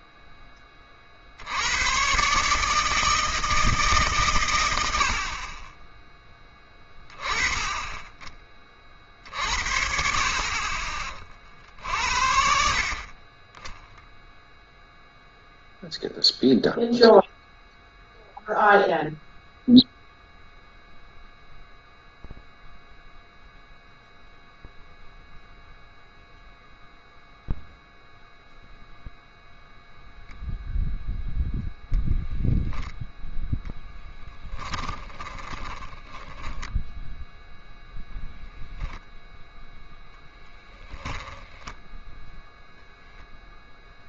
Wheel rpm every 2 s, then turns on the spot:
10, 140, 120, 20, 40, 40, 60, 0, 0, 0, 0, 0, 0, 0, 0, 0, 0, 10, 10, 0, 10, 0.
34-36